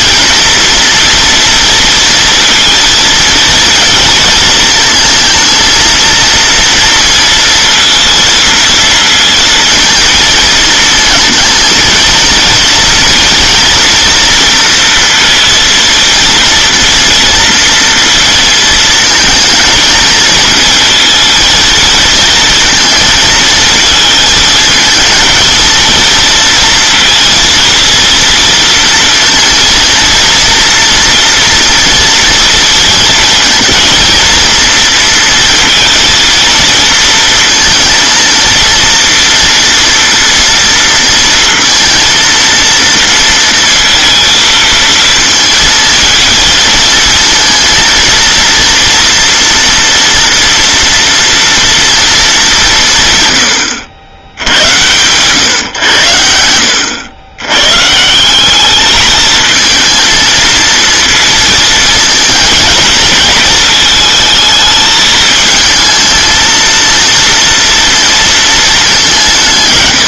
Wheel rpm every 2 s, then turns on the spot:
230, 230, 220, 230, 230, 220, 230, 230, 230, 230, 230, 230, 220, 230, 230, 230, 230, 230, 230, 230, 230, 230, 230, 230, 230, 230, 180, 90, 90, 200, 230, 230, 220, 230, 210.
none